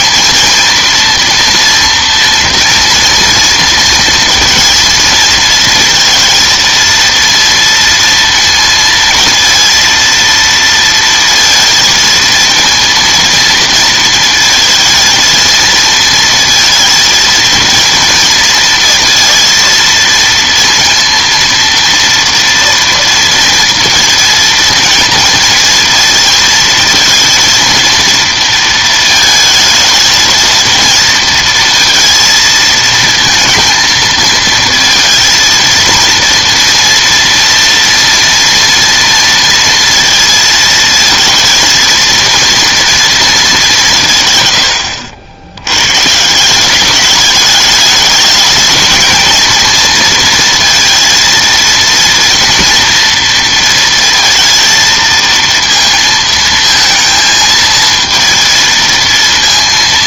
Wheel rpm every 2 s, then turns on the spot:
230, 230, 230, 230, 230, 230, 230, 230, 230, 230, 230, 230, 230, 220, 230, 230, 230, 230, 230, 230, 220, 230, 110, 190, 220, 230, 230, 230, 230, 230.
none